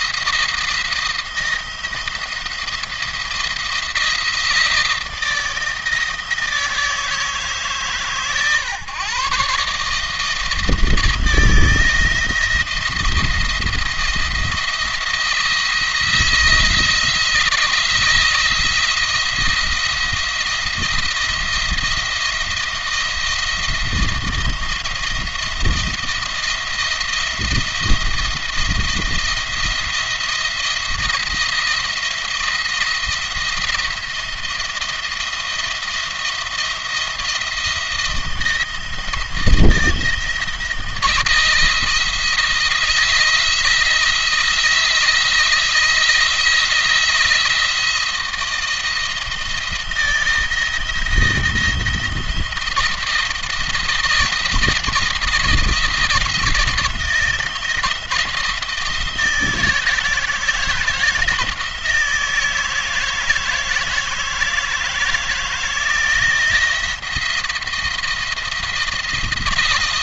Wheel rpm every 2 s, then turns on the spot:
170, 170, 160, 160, 130, 160, 170, 170, 160, 170, 170, 170, 170, 170, 170, 170, 170, 170, 170, 170, 160, 160, 160, 170, 170, 170, 170, 170, 170, 160, 160, 160, 160, 170, 170.
none